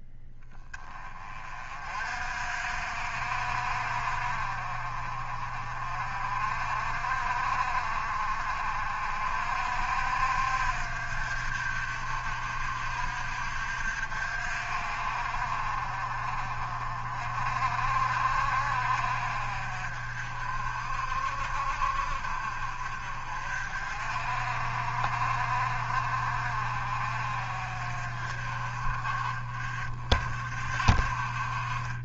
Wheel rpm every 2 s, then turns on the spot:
20, 60, 40, 50, 50, 60, 60, 50, 40, 50, 50, 50, 50, 50, 40, 40.
none